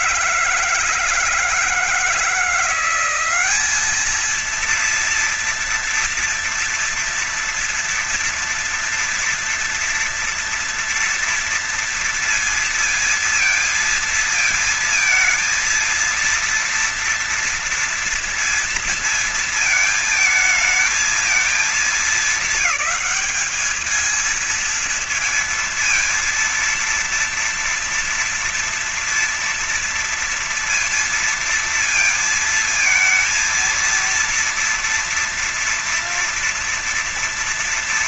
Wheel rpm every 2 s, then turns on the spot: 140, 170, 220, 230, 230, 230, 230, 220, 230, 230, 220, 220, 220, 230, 230, 230, 230, 230, 230.
none